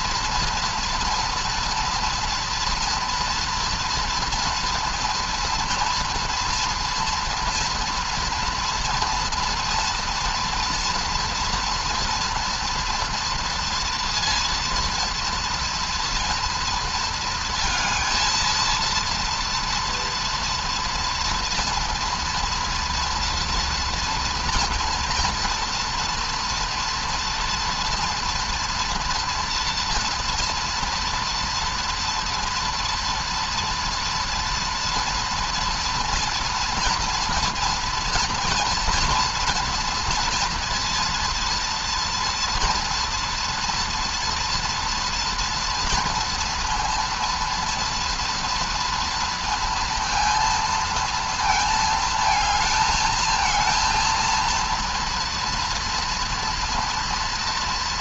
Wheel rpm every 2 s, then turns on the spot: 230, 230, 230, 240, 230, 230, 230, 240, 230, 230, 230, 230, 230, 230, 240, 240, 240, 230, 230, 230, 230, 230, 230, 230, 230, 230, 220, 230, 230.
none